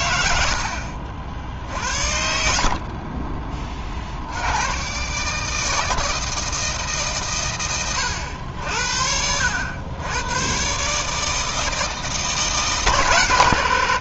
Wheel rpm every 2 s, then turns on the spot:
60, 50, 130, 150, 70, 140, 150.
2-4